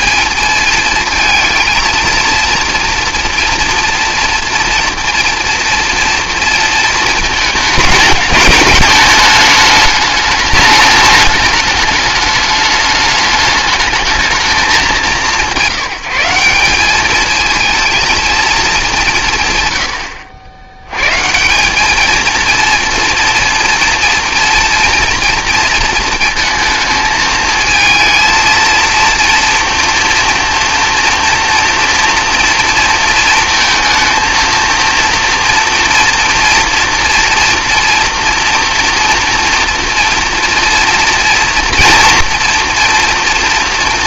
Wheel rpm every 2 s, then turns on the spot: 220, 230, 230, 230, 210, 210, 210, 200, 200, 210, 100, 230, 230, 220, 230, 230, 230, 230, 230, 240, 230, 230.
none